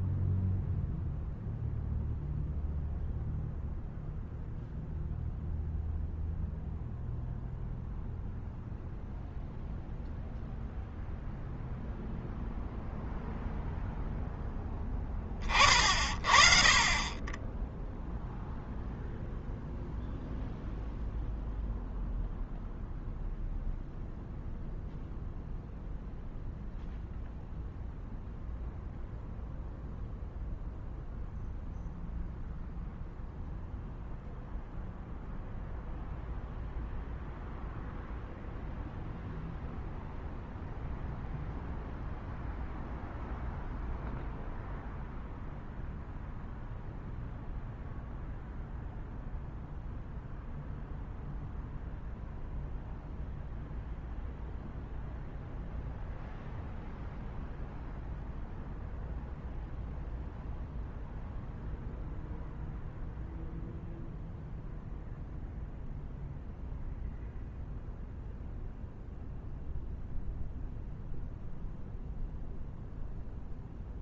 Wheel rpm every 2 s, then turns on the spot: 0, 0, 0, 0, 0, 0, 0, 10, 40, 0, 0, 0, 0, 0, 0, 0, 0, 0, 0, 0, 0, 0, 0, 0, 0, 0, 0, 0, 0, 0, 0, 0, 0, 0, 0, 0, 0.
none